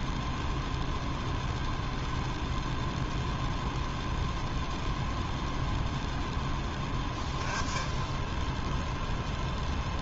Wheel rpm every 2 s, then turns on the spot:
0, 0, 0, 10, 0.
none